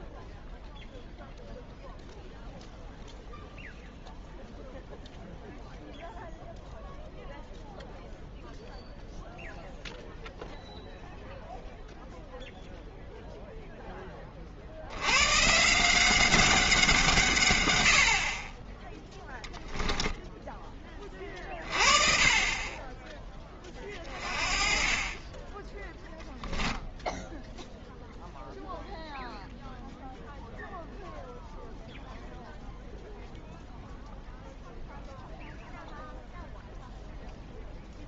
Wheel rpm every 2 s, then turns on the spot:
0, 0, 0, 0, 0, 0, 0, 70, 180, 10, 10, 20, 30, 10, 0, 0, 0, 0, 0.
26-28